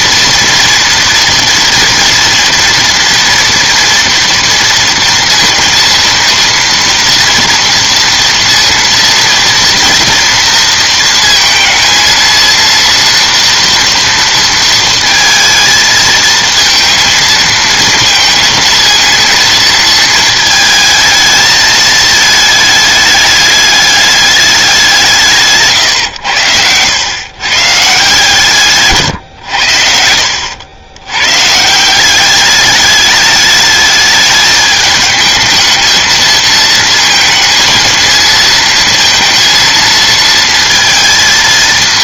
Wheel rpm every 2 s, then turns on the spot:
230, 230, 230, 230, 230, 230, 230, 230, 220, 230, 220, 220, 200, 100, 150, 80, 210, 210, 220, 220, 230.
none